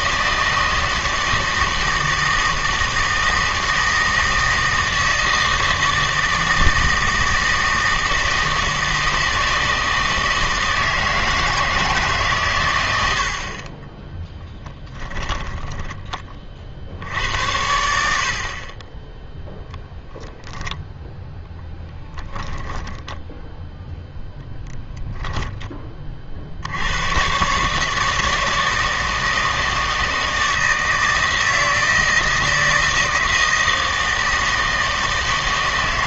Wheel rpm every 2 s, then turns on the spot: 160, 160, 160, 160, 160, 160, 70, 10, 70, 10, 0, 10, 10, 120, 160, 160, 160, 160.
14-16 22-24